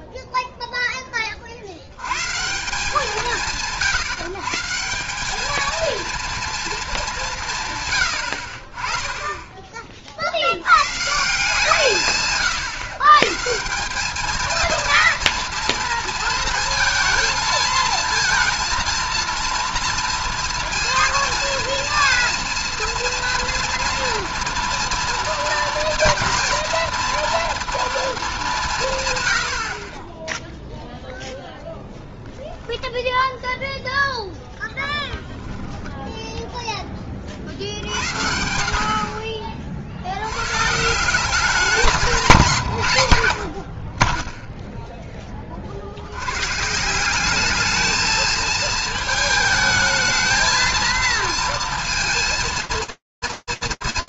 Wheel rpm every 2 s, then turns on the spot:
0, 180, 160, 220, 40, 110, 130, 230, 230, 230, 230, 230, 230, 240, 190, 0, 10, 10, 0, 60, 130, 170, 0, 120, 220, 220, 230.
none